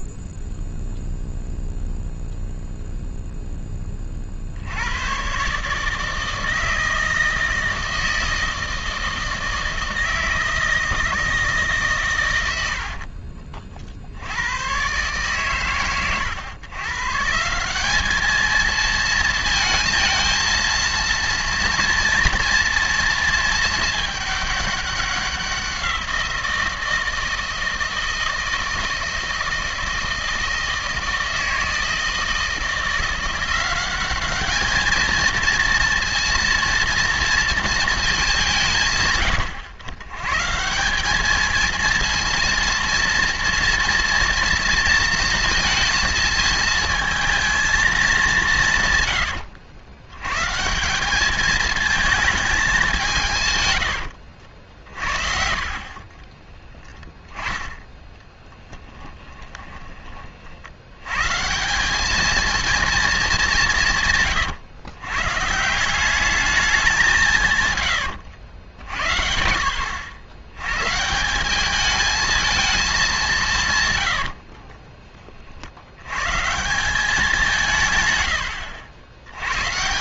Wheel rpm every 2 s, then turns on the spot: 0, 0, 30, 160, 160, 160, 130, 70, 120, 210, 220, 230, 210, 170, 160, 160, 160, 200, 230, 180, 150, 230, 230, 220, 180, 150, 210, 60, 10, 10, 80, 230, 130, 200, 90, 130, 220, 30, 170, 80.
58-60 74-76